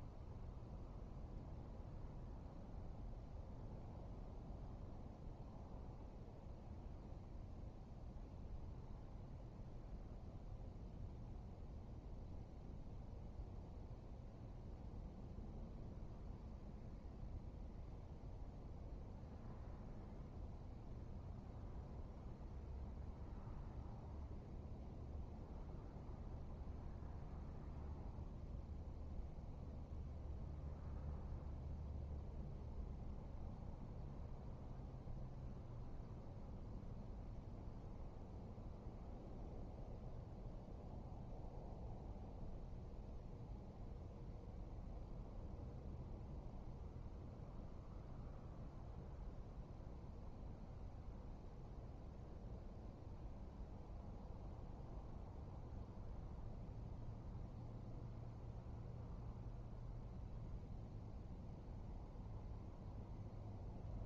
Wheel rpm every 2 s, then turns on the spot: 0, 0, 0, 0, 0, 0, 0, 0, 0, 0, 0, 0, 0, 0, 0, 0, 0, 0, 0, 0, 0, 0, 0, 0, 0, 0, 0, 0, 0, 0, 0, 0.
none